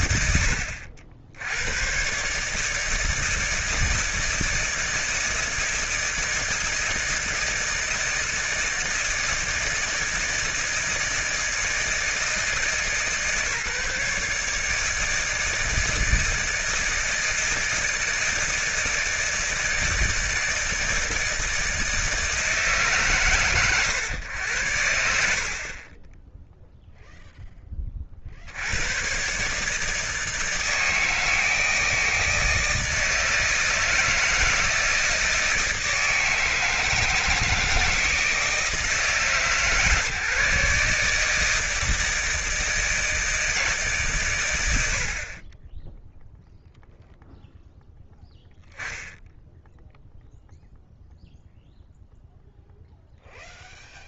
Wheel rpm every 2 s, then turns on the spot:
80, 170, 160, 160, 160, 160, 140, 160, 160, 160, 160, 130, 70, 0, 110, 160, 160, 160, 160, 160, 150, 160, 60, 0, 0, 0, 0.
none